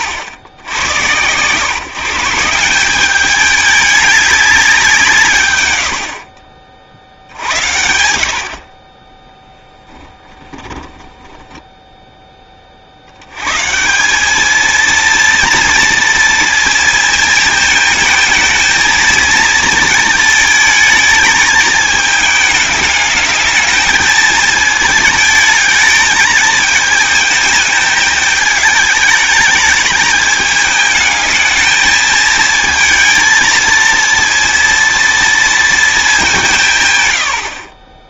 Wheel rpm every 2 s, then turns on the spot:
90, 190, 180, 50, 30, 20, 50, 230, 230, 230, 220, 220, 220, 220, 210, 210, 220, 230, 120.
10-12